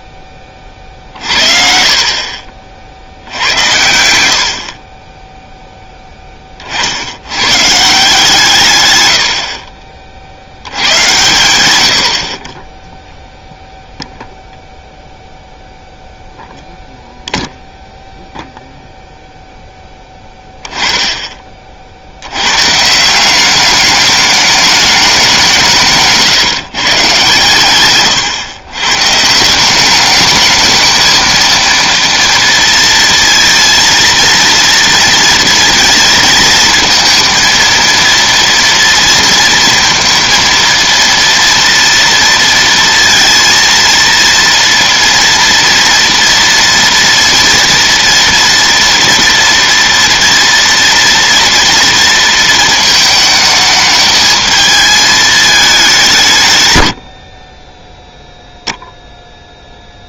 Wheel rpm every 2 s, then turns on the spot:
40, 60, 30, 60, 120, 100, 10, 0, 0, 0, 10, 150, 210, 150, 130, 220, 230, 230, 220, 230, 230, 230, 230, 230, 230, 230, 220, 220, 100, 0.
4-6